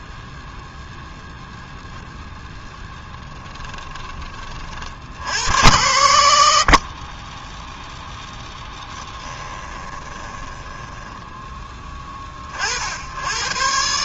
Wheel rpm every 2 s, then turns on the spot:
0, 10, 40, 50, 10, 20, 50.
2-4 8-12